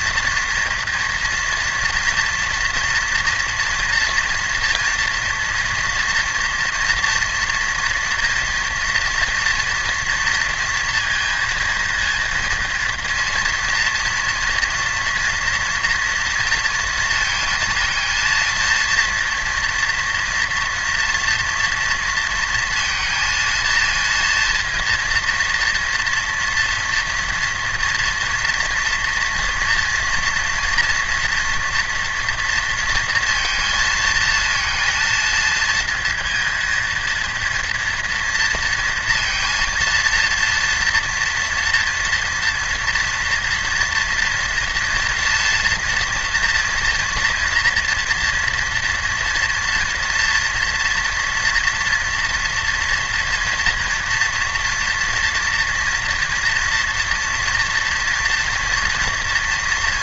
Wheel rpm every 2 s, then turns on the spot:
230, 230, 230, 240, 240, 230, 230, 240, 230, 230, 230, 230, 230, 230, 230, 230, 230, 230, 230, 230, 230, 230, 230, 240, 230, 230, 230, 230, 230, 230.
none